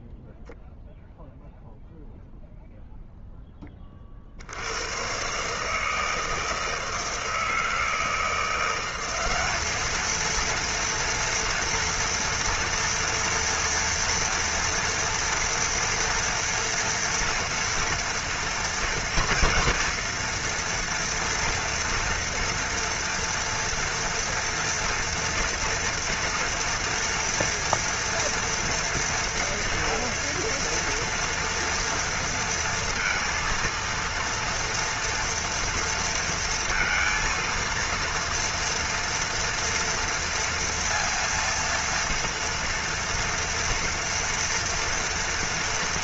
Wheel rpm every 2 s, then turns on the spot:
0, 0, 100, 160, 180, 230, 230, 230, 230, 230, 230, 230, 230, 230, 230, 230, 230, 230, 230, 230, 230, 240, 230.
none